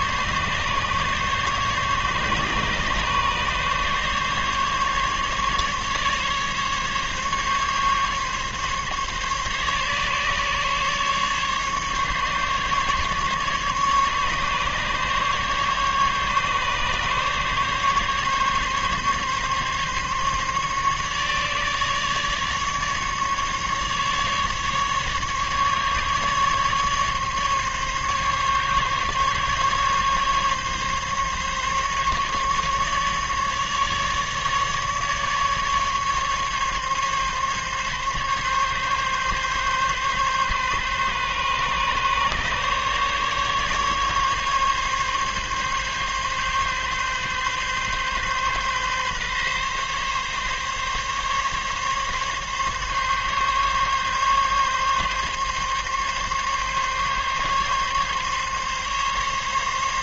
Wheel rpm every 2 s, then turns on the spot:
140, 140, 140, 140, 140, 140, 140, 140, 140, 140, 150, 150, 150, 140, 140, 140, 150, 150, 140, 140, 140, 140, 140, 140, 140, 140, 140, 140, 140, 140.
none